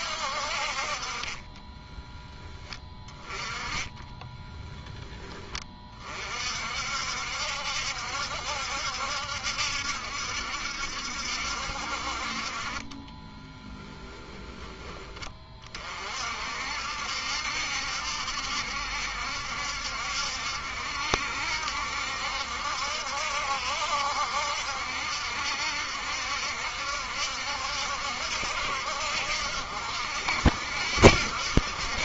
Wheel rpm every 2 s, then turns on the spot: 50, 20, 10, 60, 70, 70, 30, 20, 60, 70, 70, 70, 70, 70, 70, 70.
12-14